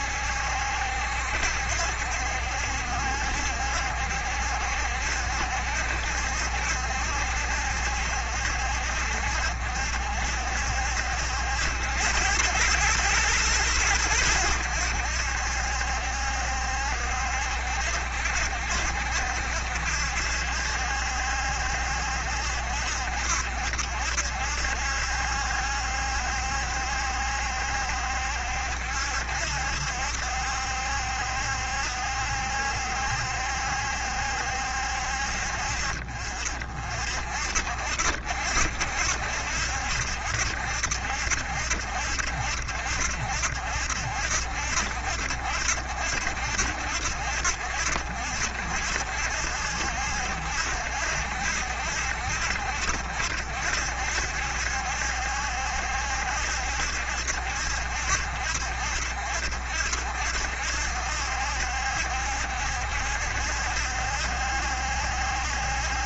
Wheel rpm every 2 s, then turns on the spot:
70, 70, 70, 70, 70, 70, 100, 90, 70, 70, 70, 70, 70, 70, 70, 70, 70, 70, 50, 70, 70, 70, 70, 70, 70, 70, 70, 70, 70, 70, 70, 70, 70.
none